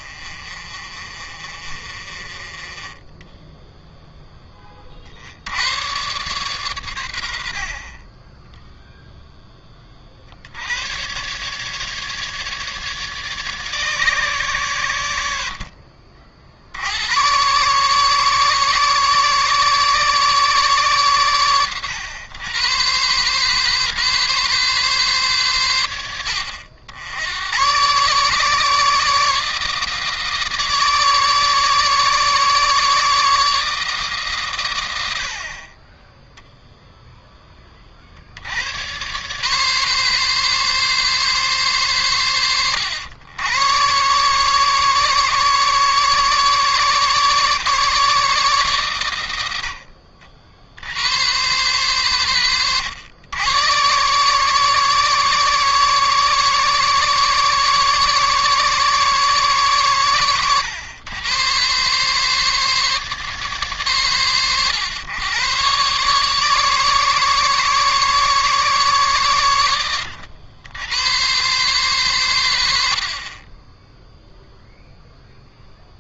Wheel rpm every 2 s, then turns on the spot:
40, 20, 20, 120, 10, 70, 150, 120, 70, 140, 140, 110, 140, 80, 140, 150, 150, 110, 0, 90, 140, 90, 140, 140, 140, 70, 120, 140, 140, 140, 110, 150, 120, 140, 140, 90, 90, 0.
0-4